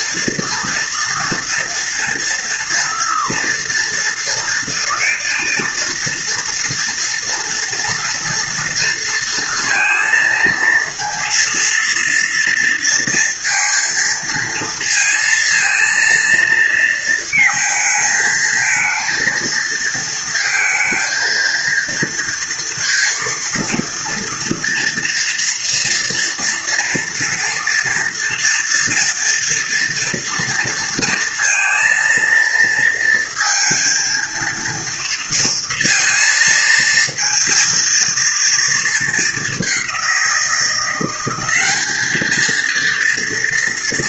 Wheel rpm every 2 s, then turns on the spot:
240, 230, 230, 230, 230, 230, 230, 230, 230, 220, 230, 230, 230, 230, 240, 230, 230, 230, 230, 230, 180, 220.
none